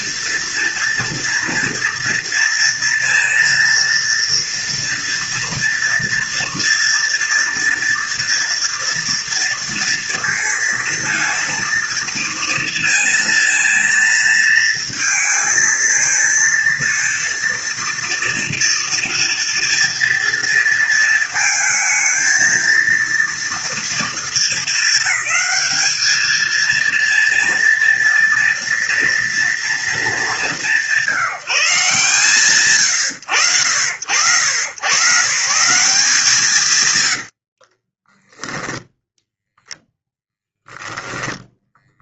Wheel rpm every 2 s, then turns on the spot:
230, 230, 230, 230, 230, 230, 230, 230, 230, 230, 230, 230, 230, 220, 230, 200, 150, 90, 160, 20, 0.
38-40